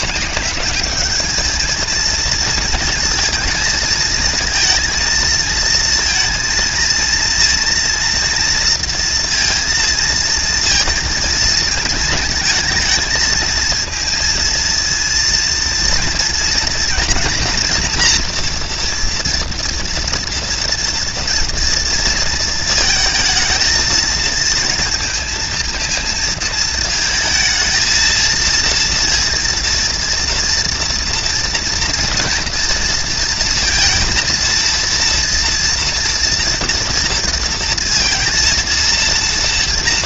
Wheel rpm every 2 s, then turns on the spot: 210, 230, 220, 230, 230, 230, 230, 230, 230, 240, 230, 220, 230, 220, 230, 230, 230, 230, 240, 230.
none